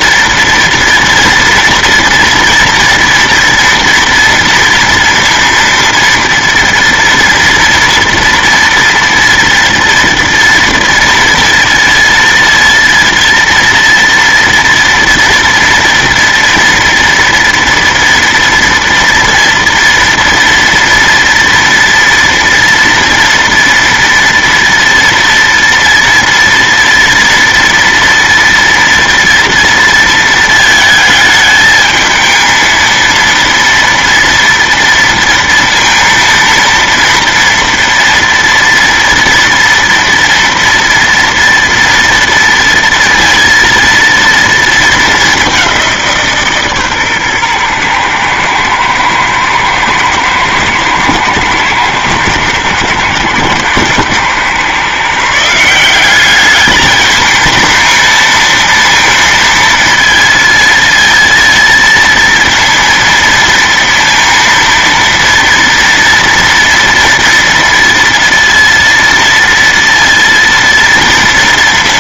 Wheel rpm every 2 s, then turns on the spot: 230, 230, 230, 230, 230, 240, 230, 230, 230, 230, 230, 230, 230, 230, 230, 220, 220, 230, 230, 230, 230, 230, 230, 150, 110, 110, 110, 130, 210, 230, 230, 230, 230, 230, 230, 230.
none